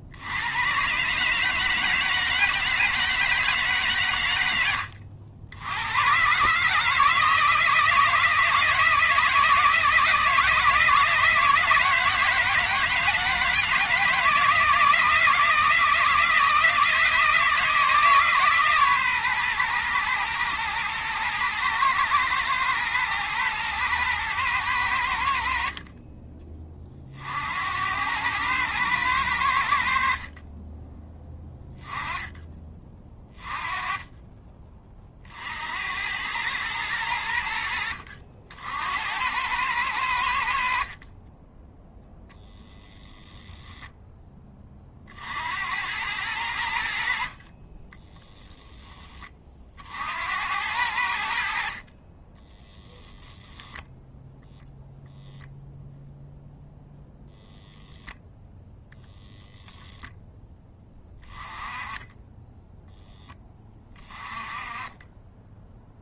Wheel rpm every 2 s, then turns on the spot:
120, 160, 90, 150, 160, 160, 160, 160, 160, 140, 110, 120, 100, 30, 110, 30, 20, 30, 100, 80, 50, 10, 40, 70, 20, 80, 10, 0, 0, 0, 10, 0, 20.
48-50 52-54